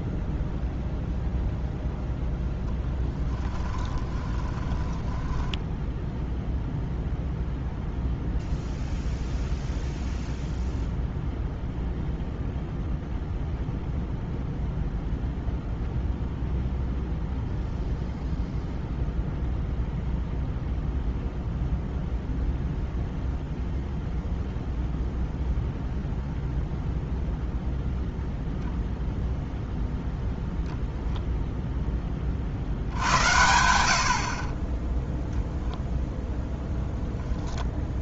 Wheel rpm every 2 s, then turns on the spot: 0, 0, 20, 0, 0, 0, 0, 0, 0, 0, 0, 0, 0, 0, 0, 0, 50, 30, 0.
4-6